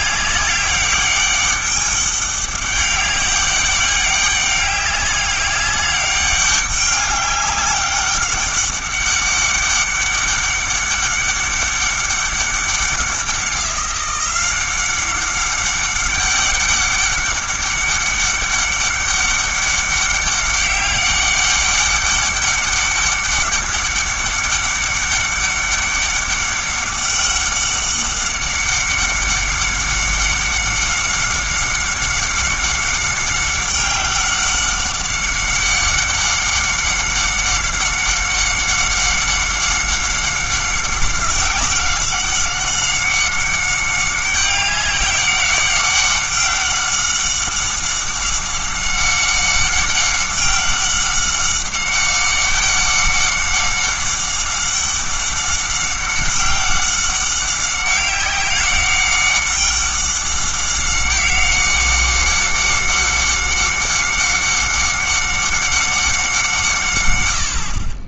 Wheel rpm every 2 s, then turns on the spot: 200, 200, 200, 200, 200, 190, 190, 190, 200, 200, 200, 200, 200, 200, 200, 190, 190, 190, 190, 190, 190, 190, 200, 190, 190, 190, 200, 190, 190, 200, 190, 190, 190, 160.
none